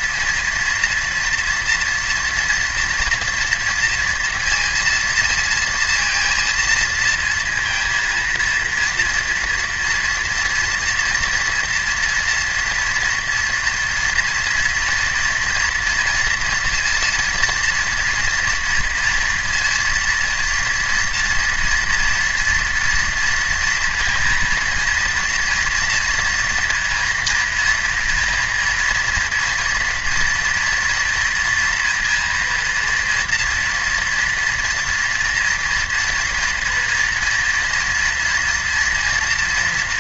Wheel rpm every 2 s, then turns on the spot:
230, 230, 230, 230, 230, 240, 230, 230, 230, 230, 230, 230, 230, 230, 230, 230, 230, 230, 240, 230.
none